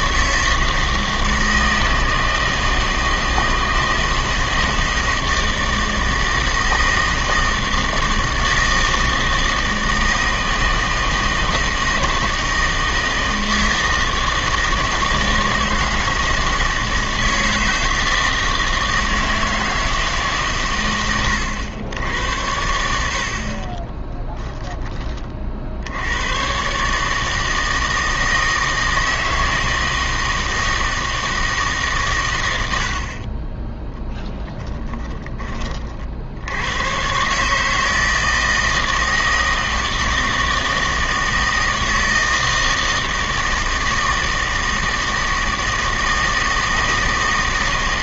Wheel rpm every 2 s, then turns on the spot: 160, 160, 160, 160, 160, 160, 160, 160, 160, 160, 120, 80, 20, 130, 160, 160, 80, 10, 100, 160, 160, 160, 160, 160.
34-36